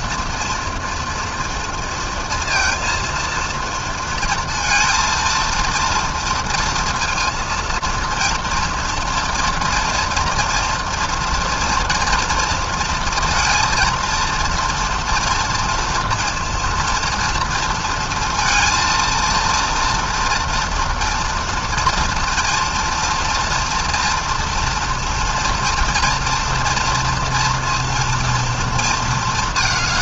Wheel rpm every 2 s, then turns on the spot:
240, 230, 230, 230, 230, 230, 230, 230, 230, 230, 230, 240, 240, 230, 230.
none